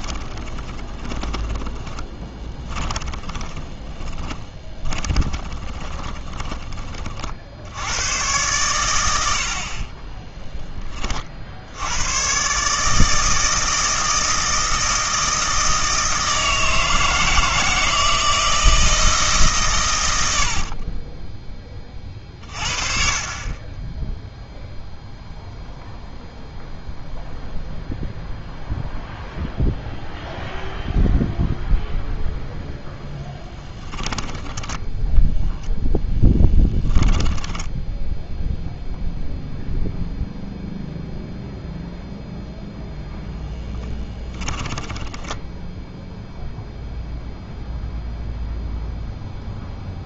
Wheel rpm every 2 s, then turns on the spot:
10, 20, 20, 30, 110, 20, 150, 160, 160, 160, 60, 40, 0, 0, 0, 0, 0, 10, 10, 0, 0, 0, 10, 0, 0.
0-6 20-22 34-38 44-46